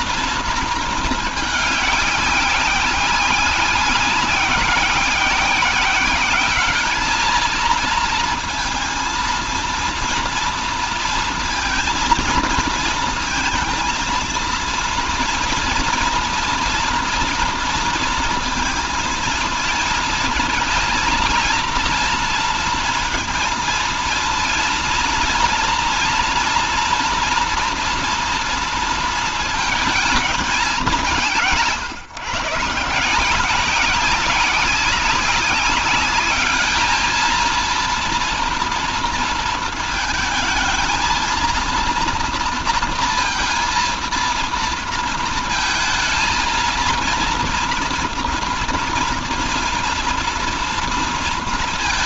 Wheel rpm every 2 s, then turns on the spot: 230, 190, 190, 210, 230, 230, 230, 230, 230, 230, 230, 230, 230, 230, 230, 200, 150, 190, 210, 230, 230, 230, 230, 230, 230, 230.
none